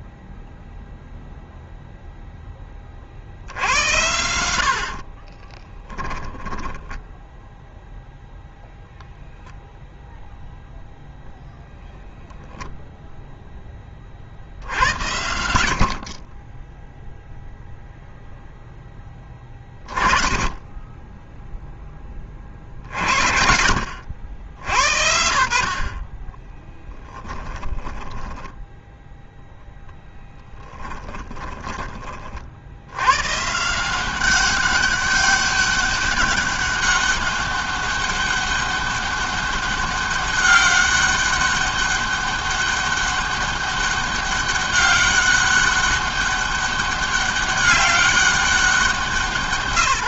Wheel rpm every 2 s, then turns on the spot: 0, 40, 50, 10, 0, 0, 0, 90, 20, 10, 10, 50, 70, 10, 0, 20, 90, 200, 200, 200, 200, 200, 200, 200, 190.
4-8 26-28 30-32